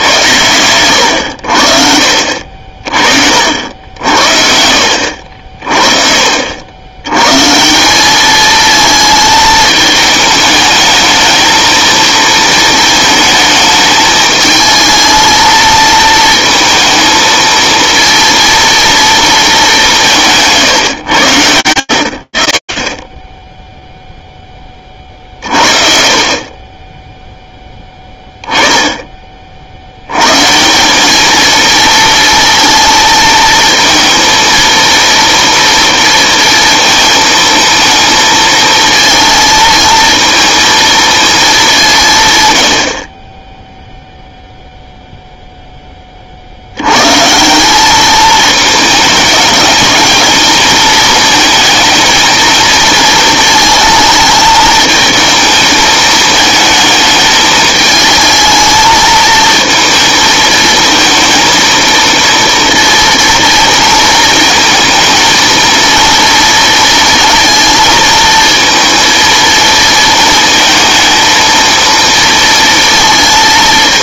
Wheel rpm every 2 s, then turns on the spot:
90, 50, 60, 80, 220, 210, 230, 220, 220, 230, 150, 40, 20, 30, 10, 160, 230, 230, 230, 220, 230, 110, 0, 80, 220, 220, 230, 220, 220, 220, 220, 230, 220, 230, 230, 230, 230.
none